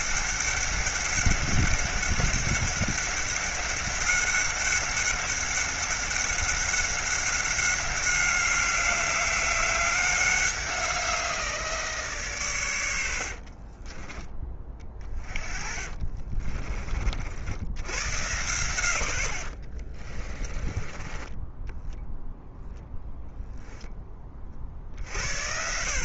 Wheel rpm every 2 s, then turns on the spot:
200, 200, 200, 190, 190, 180, 90, 30, 50, 80, 20, 0, 50.
14-16 20-22